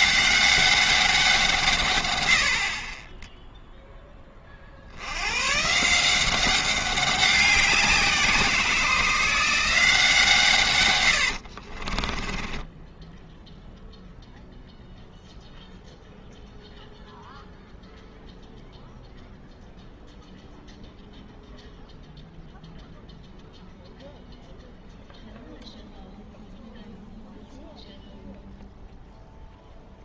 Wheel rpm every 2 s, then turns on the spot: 200, 40, 50, 190, 170, 120, 10, 0, 0, 0, 0, 0, 0, 0, 0.
12-14